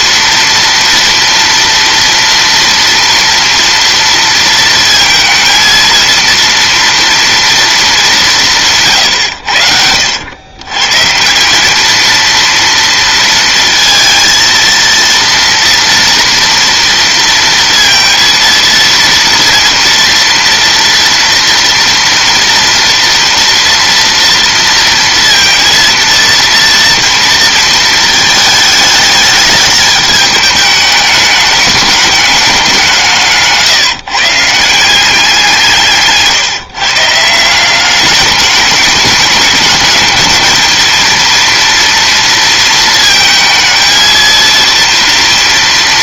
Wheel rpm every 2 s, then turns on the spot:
230, 230, 230, 230, 160, 120, 230, 230, 230, 230, 230, 230, 230, 230, 210, 210, 190, 160, 150, 210, 220, 230, 230.
none